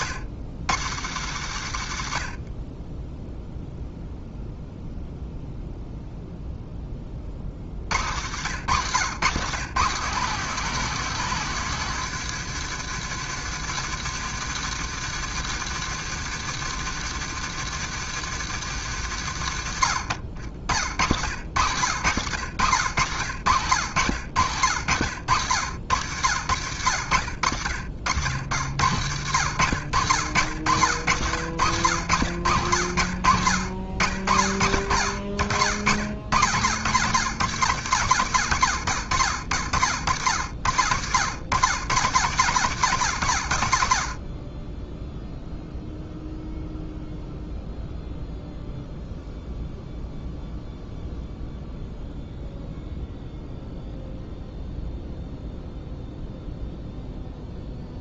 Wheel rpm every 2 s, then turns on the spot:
90, 20, 0, 20, 110, 200, 160, 160, 160, 130, 60, 90, 80, 70, 80, 70, 70, 40, 80, 50, 70, 60, 0, 0, 0, 0, 0, 0, 0.
none